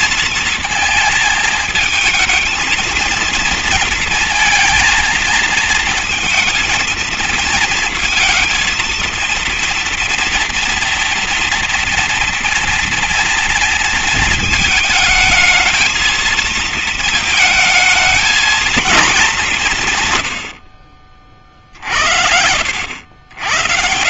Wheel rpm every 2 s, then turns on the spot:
230, 230, 230, 220, 230, 230, 230, 220, 220, 220, 80, 70.
none